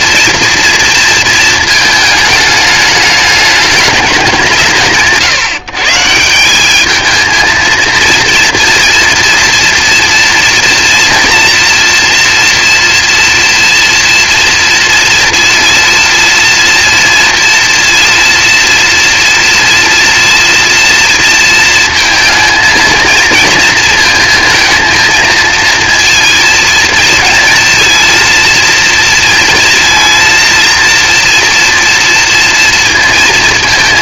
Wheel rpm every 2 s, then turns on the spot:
230, 210, 170, 190, 230, 230, 230, 230, 230, 230, 230, 220, 230, 230, 230, 230, 230.
none